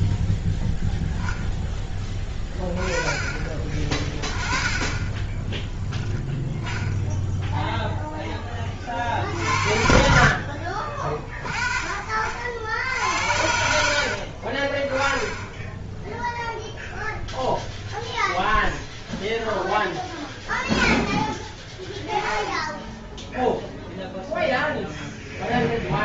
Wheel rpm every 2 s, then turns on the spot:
0, 20, 20, 0, 50, 40, 80, 20, 0, 0, 10, 0, 0.
none